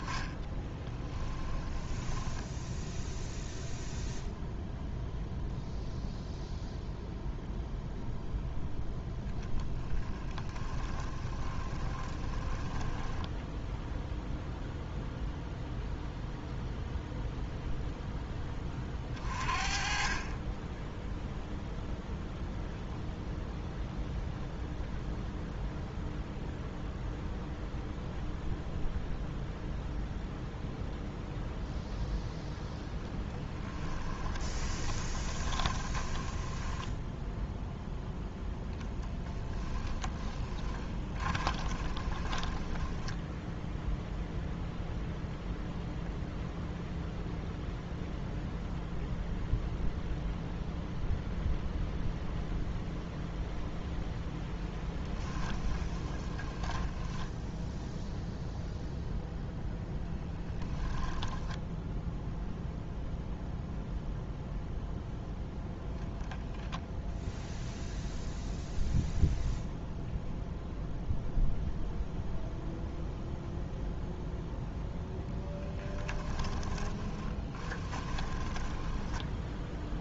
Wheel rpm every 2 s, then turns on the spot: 10, 0, 0, 0, 0, 20, 10, 0, 0, 30, 10, 0, 0, 0, 0, 0, 0, 20, 10, 10, 20, 10, 0, 0, 0, 0, 0, 10, 10, 0, 10, 0, 0, 0, 0, 0, 0, 0, 20, 10.
0-2 10-14 34-44 54-58 60-62 76-80